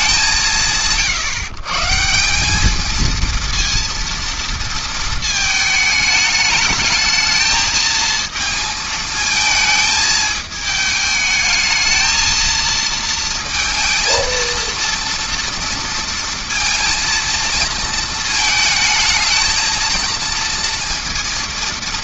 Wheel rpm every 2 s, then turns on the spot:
140, 230, 220, 220, 220, 220, 230, 230, 230, 220, 230.
none